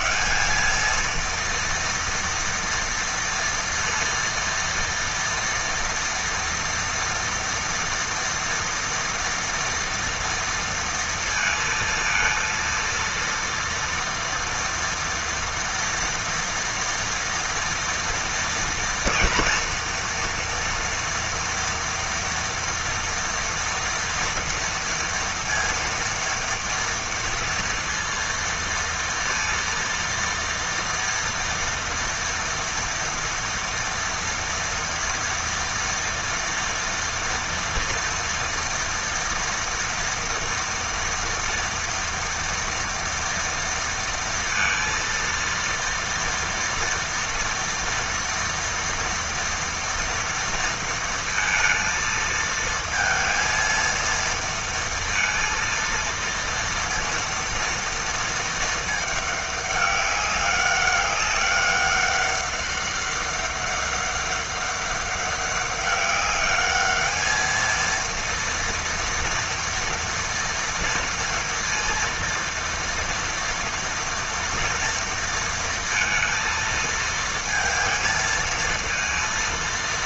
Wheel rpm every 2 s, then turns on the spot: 220, 230, 230, 230, 230, 230, 230, 230, 240, 230, 230, 230, 230, 230, 230, 230, 240, 230, 230, 230, 230, 230, 230, 230, 230, 230, 230, 230, 230, 220, 200, 200, 200, 210, 230, 230, 230, 230, 230, 220.
none